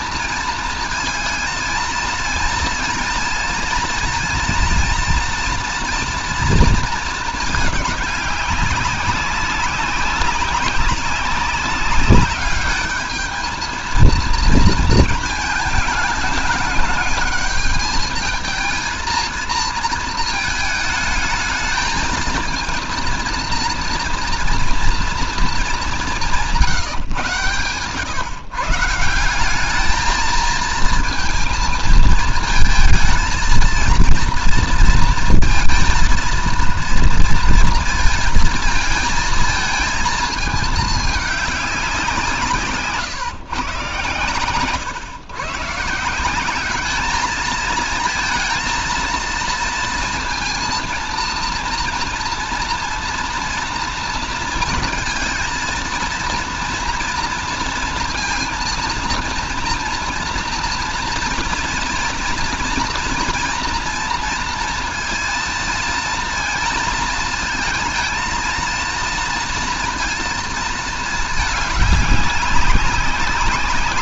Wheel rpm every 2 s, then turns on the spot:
230, 220, 240, 230, 190, 190, 210, 230, 210, 220, 220, 230, 230, 160, 150, 230, 220, 230, 230, 220, 220, 150, 120, 210, 230, 230, 230, 230, 230, 230, 230, 230, 230, 230, 230, 220, 200.
none